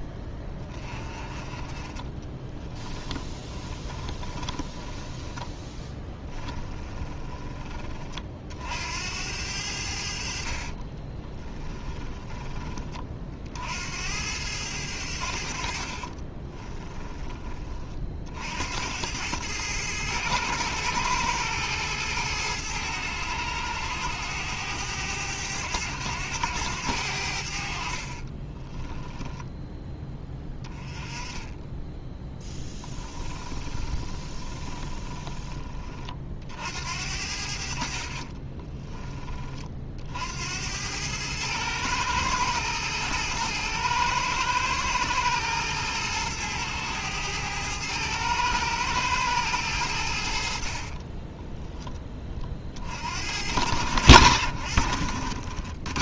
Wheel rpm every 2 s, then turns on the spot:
10, 20, 20, 20, 50, 60, 20, 90, 30, 70, 110, 110, 100, 100, 20, 10, 10, 20, 60, 20, 80, 110, 110, 110, 110, 40, 60, 70.
2-8 10-12 16-18 28-30 32-36 38-40 50-52